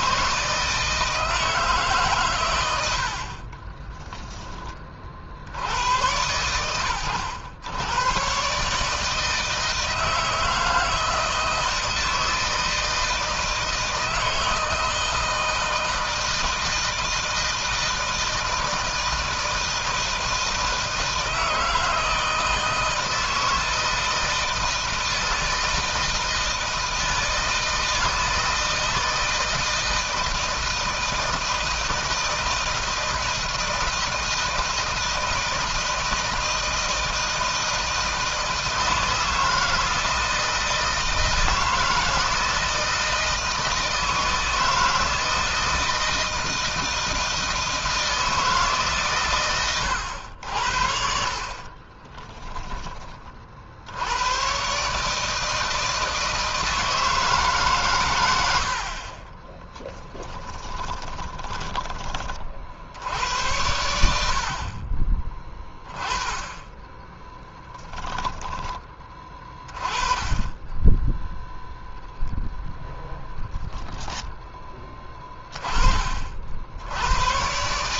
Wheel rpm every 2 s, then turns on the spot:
160, 80, 40, 110, 140, 160, 160, 160, 160, 160, 160, 160, 160, 160, 160, 160, 160, 160, 160, 160, 160, 160, 160, 160, 140, 60, 20, 140, 160, 70, 10, 70, 30, 10, 20, 10, 20, 20, 70.
60-62 72-74